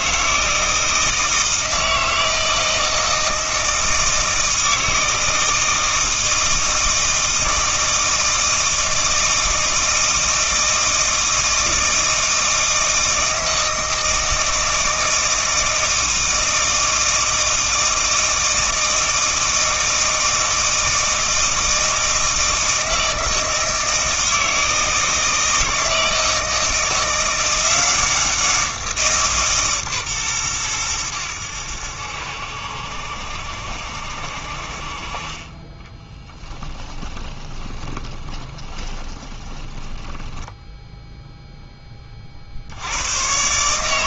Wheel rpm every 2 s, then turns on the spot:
160, 160, 160, 160, 160, 160, 160, 160, 160, 160, 160, 160, 160, 160, 170, 100, 70, 50, 20, 20, 10, 70.
36-42